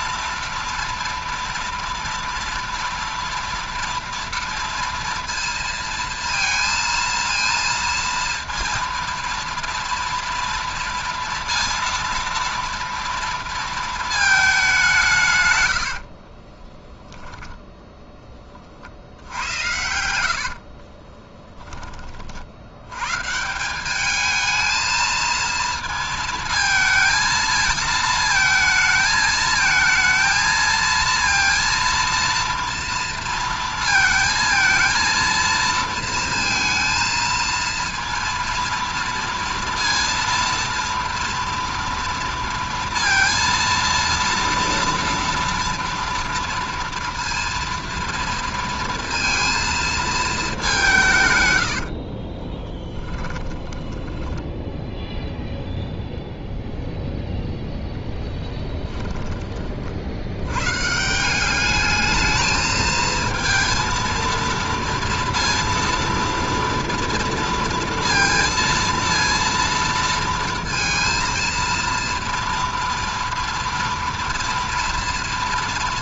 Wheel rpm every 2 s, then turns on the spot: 230, 230, 230, 230, 230, 230, 230, 210, 20, 30, 60, 70, 220, 230, 220, 230, 230, 230, 230, 230, 230, 230, 230, 230, 230, 200, 20, 10, 0, 10, 130, 220, 230, 230, 230, 230, 230, 240.
16-18 20-22 52-56 58-60